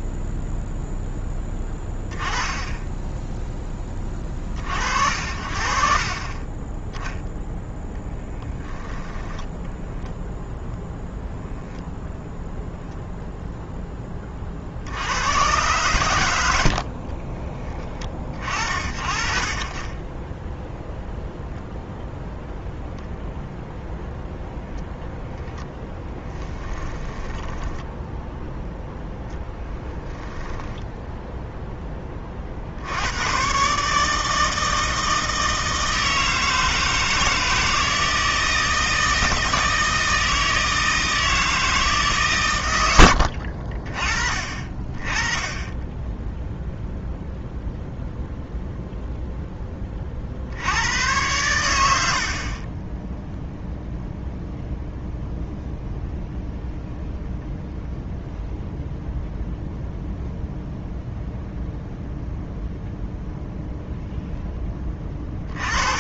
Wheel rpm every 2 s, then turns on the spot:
0, 10, 50, 10, 10, 0, 0, 70, 50, 40, 0, 0, 0, 10, 0, 0, 70, 160, 160, 160, 160, 100, 30, 0, 0, 90, 20, 0, 0, 0, 0, 0, 20.
8-10 26-28